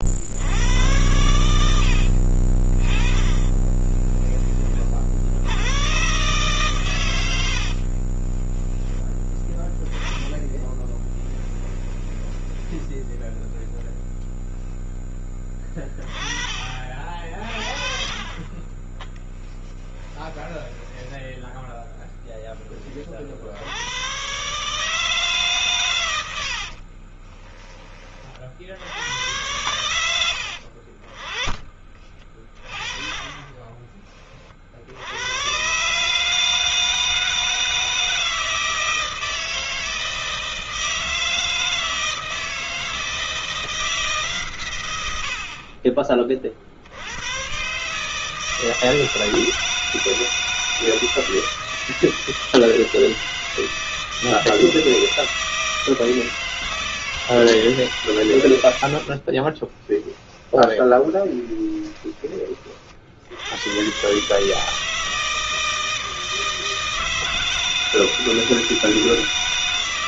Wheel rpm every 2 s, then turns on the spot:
50, 70, 30, 130, 30, 10, 10, 0, 20, 20, 10, 10, 120, 90, 40, 90, 30, 30, 150, 160, 160, 160, 150, 40, 150, 160, 160, 160, 160, 100, 10, 20, 140, 160, 160.
8-14 20-22 26-28 60-62